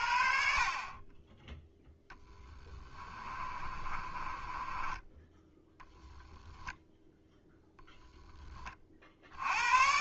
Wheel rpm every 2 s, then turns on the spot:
40, 20, 20, 10, 30.
2-6